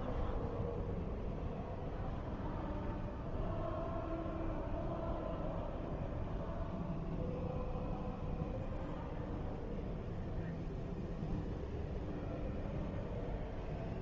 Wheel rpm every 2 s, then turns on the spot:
0, 0, 0, 0, 0, 0, 0.
none